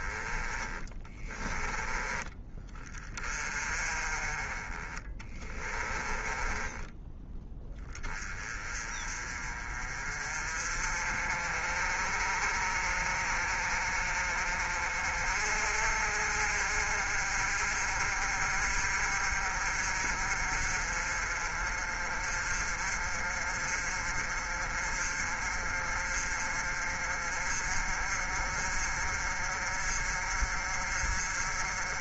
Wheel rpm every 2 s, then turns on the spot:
20, 20, 30, 10, 30, 40, 40, 50, 50, 50, 40, 40, 40, 40, 50, 50.
4-8